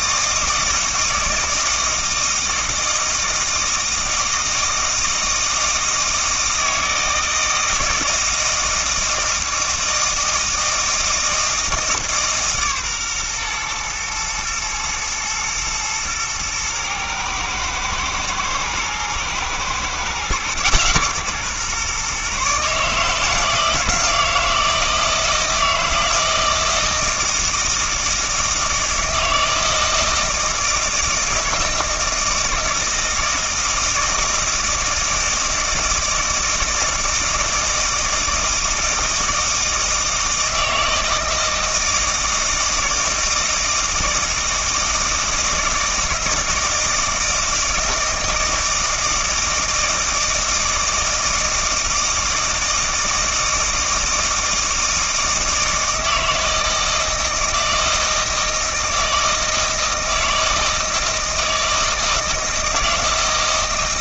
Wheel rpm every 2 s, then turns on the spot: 160, 160, 160, 160, 160, 160, 140, 120, 110, 120, 130, 150, 160, 160, 160, 160, 160, 160, 160, 160, 160, 160, 160, 160, 160, 160, 160, 160, 160, 160, 160, 160.
none